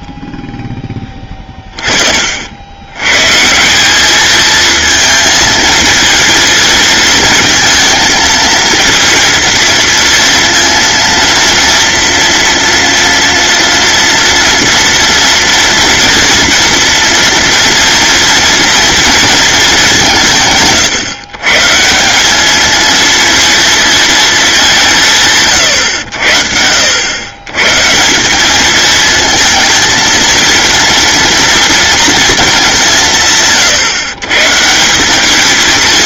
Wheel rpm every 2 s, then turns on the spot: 10, 100, 220, 220, 230, 230, 230, 230, 230, 230, 140, 220, 160, 90, 220, 230, 190, 180.
none